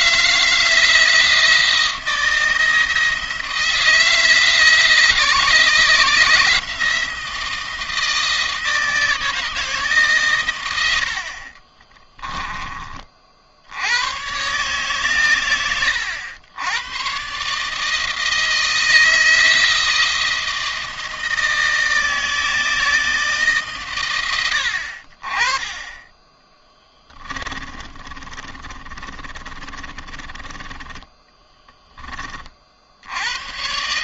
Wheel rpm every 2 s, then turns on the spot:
160, 160, 160, 160, 160, 90, 30, 140, 120, 160, 160, 160, 60, 20, 30, 20, 70.
26-32